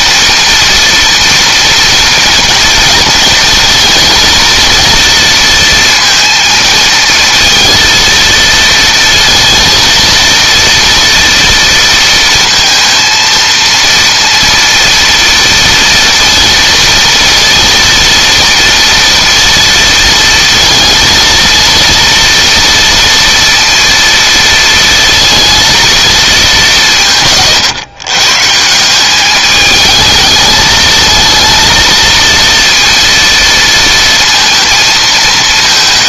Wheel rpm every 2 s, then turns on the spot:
230, 240, 230, 230, 230, 230, 230, 230, 230, 230, 230, 230, 230, 180, 170, 220, 230, 230.
none